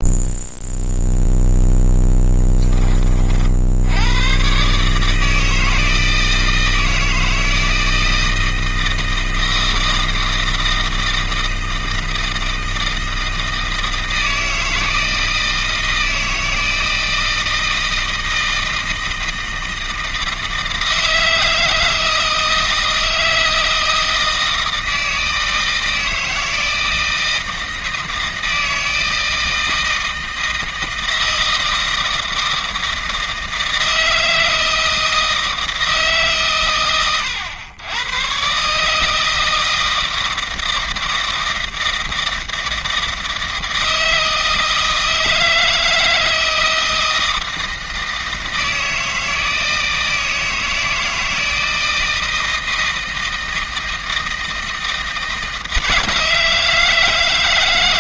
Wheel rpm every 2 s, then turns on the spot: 0, 30, 150, 160, 160, 160, 160, 160, 160, 160, 160, 160, 160, 160, 160, 160, 160, 160, 110, 150, 160, 160, 160, 160, 160, 160, 160, 160, 160.
none